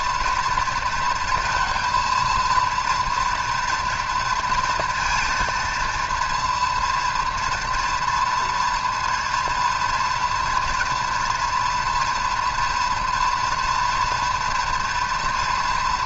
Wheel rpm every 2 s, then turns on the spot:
230, 230, 220, 230, 230, 230, 230, 230.
none